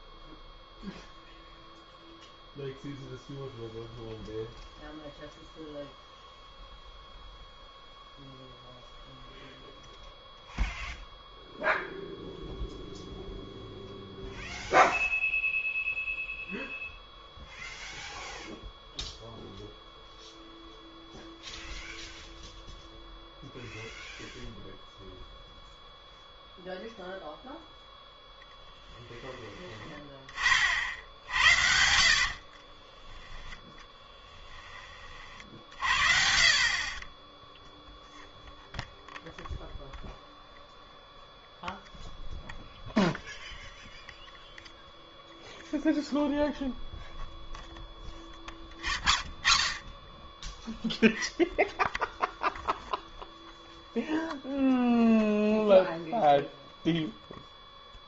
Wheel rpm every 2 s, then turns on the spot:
0, 0, 0, 0, 0, 0, 0, 0, 0, 0, 0, 0, 0, 0, 10, 40, 30, 20, 40, 0, 0, 0, 0, 0, 0, 0, 0, 0, 0.
28-34